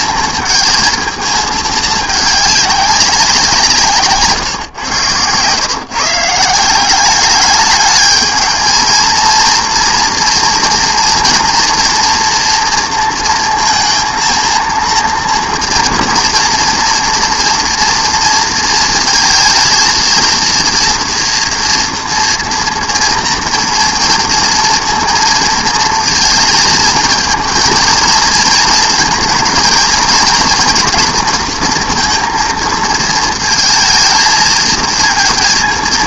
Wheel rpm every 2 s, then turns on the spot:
220, 190, 110, 190, 220, 240, 230, 230, 230, 230, 230, 230, 230, 230, 230, 230, 220, 230.
none